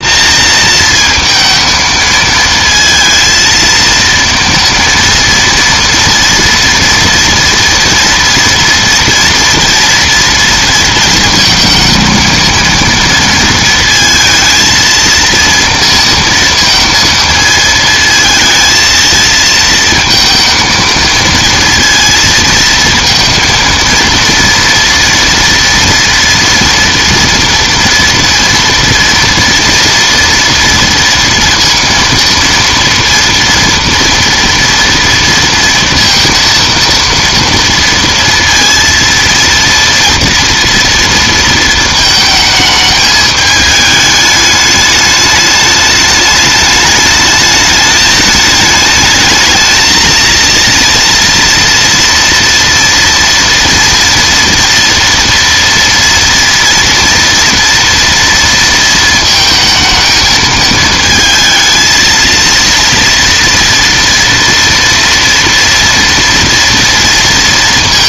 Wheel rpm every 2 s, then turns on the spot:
230, 230, 230, 230, 230, 230, 230, 230, 230, 220, 230, 230, 230, 230, 230, 230, 230, 230, 230, 230, 230, 220, 210, 210, 220, 230, 230, 230, 230, 230, 220, 230, 230, 230.
none